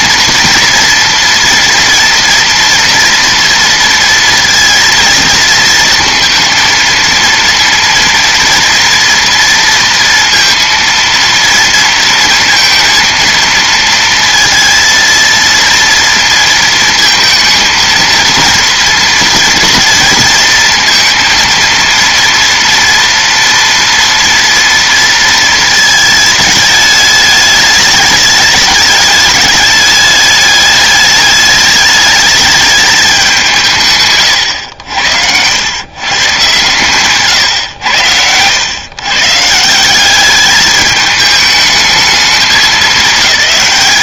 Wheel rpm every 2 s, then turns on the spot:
230, 230, 230, 230, 230, 230, 230, 230, 220, 230, 230, 240, 230, 210, 210, 210, 210, 90, 140, 110, 210, 220.
none